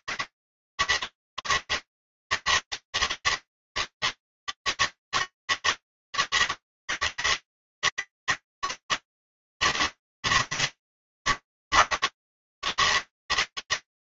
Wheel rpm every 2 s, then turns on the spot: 140, 160, 160, 160, 160, 150, 150.
none